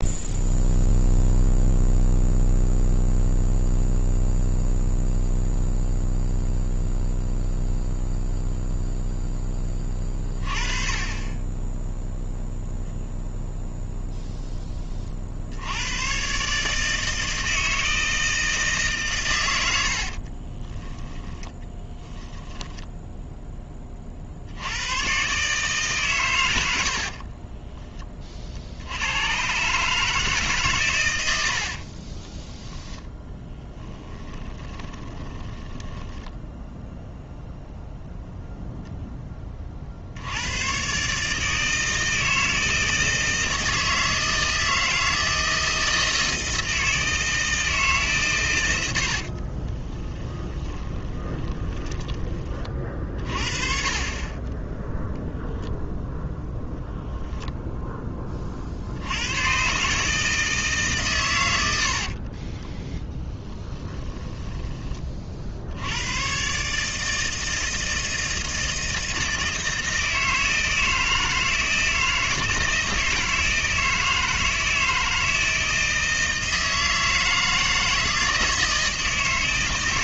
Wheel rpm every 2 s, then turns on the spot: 0, 0, 0, 0, 0, 30, 0, 10, 150, 160, 30, 10, 80, 90, 50, 140, 10, 20, 10, 0, 110, 160, 160, 160, 110, 20, 30, 20, 0, 40, 150, 30, 10, 130, 160, 160, 160, 160, 160, 160.
20-24 34-38 50-52 54-56 62-64